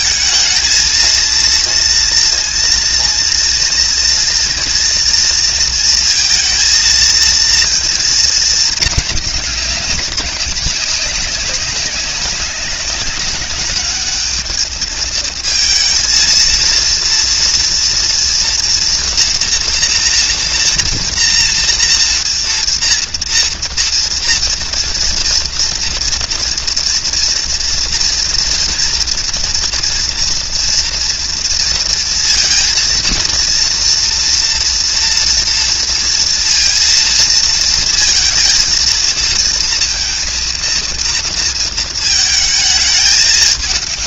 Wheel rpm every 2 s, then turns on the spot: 220, 230, 230, 230, 210, 190, 190, 220, 230, 230, 240, 230, 230, 230, 230, 230, 230, 230, 230, 230, 230, 220.
none